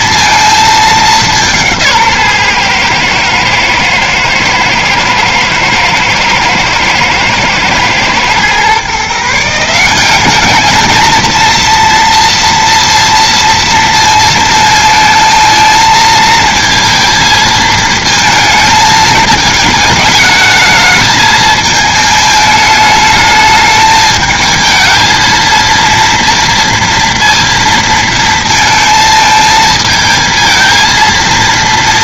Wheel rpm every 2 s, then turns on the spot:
220, 120, 110, 120, 140, 220, 230, 230, 220, 220, 220, 210, 220, 230, 230, 230.
none